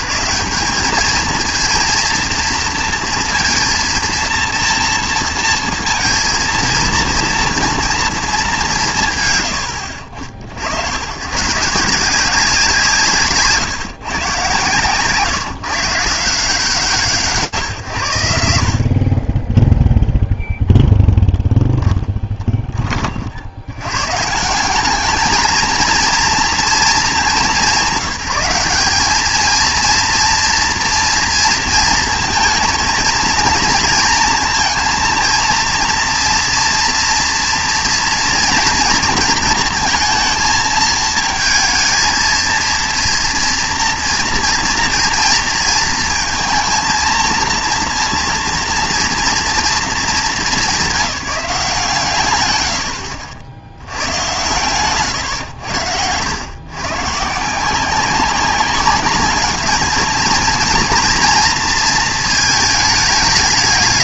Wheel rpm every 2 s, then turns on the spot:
190, 230, 230, 230, 170, 90, 170, 140, 180, 80, 0, 20, 180, 230, 200, 230, 230, 230, 230, 230, 220, 230, 230, 230, 230, 210, 100, 120, 130, 200, 230, 220.
none